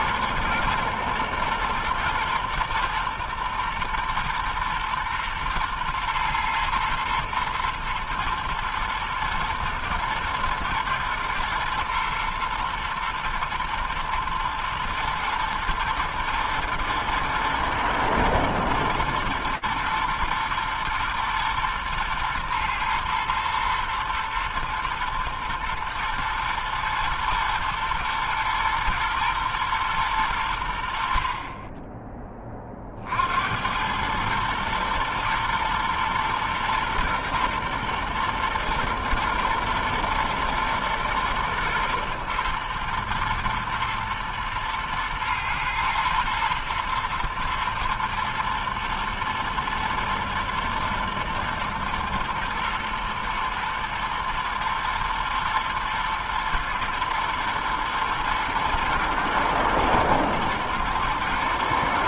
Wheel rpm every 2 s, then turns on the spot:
120, 120, 120, 120, 120, 110, 120, 110, 120, 120, 120, 120, 120, 120, 120, 100, 20, 110, 120, 120, 120, 120, 120, 110, 110, 110, 120, 120, 120, 110, 110.
none